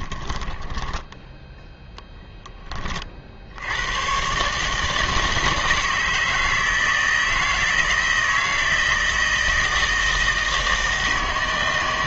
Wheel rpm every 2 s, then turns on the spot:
10, 20, 150, 160, 160, 160.
0-2